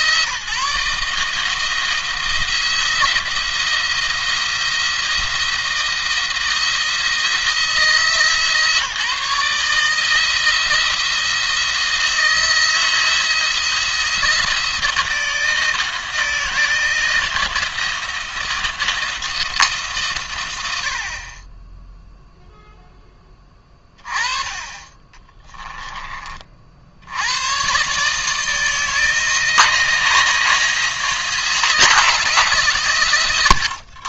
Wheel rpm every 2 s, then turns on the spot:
150, 170, 170, 160, 150, 160, 160, 170, 160, 160, 70, 0, 20, 50, 160, 170, 130.
24-26